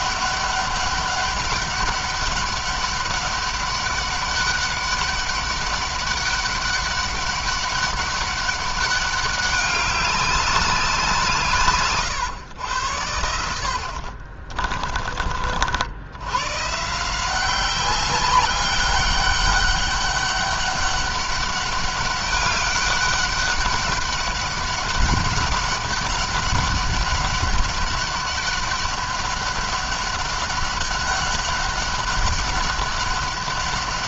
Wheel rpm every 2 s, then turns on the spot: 200, 200, 200, 200, 200, 190, 110, 40, 130, 190, 200, 200, 200, 200, 200, 200, 200.
14-16